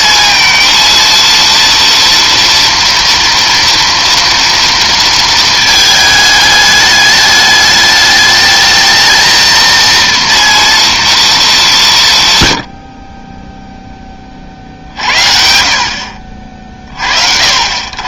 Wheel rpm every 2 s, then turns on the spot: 230, 230, 230, 210, 210, 230, 100, 50, 40.
none